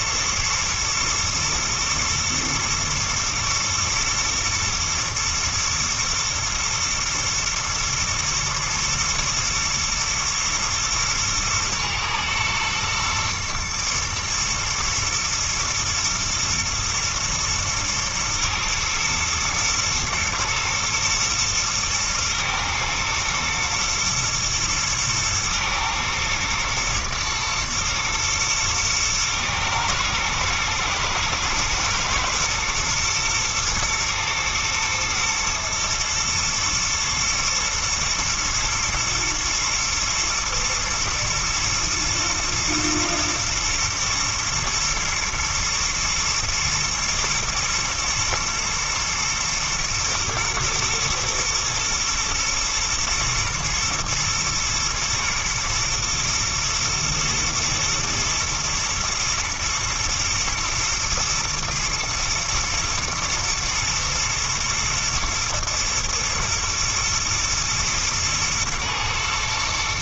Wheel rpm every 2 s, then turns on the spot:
110, 120, 110, 120, 110, 110, 120, 110, 120, 110, 110, 110, 110, 110, 110, 110, 120, 120, 110, 110, 120, 110, 110, 120, 110, 110, 120, 120, 120, 120, 110, 110, 110, 110, 110.
none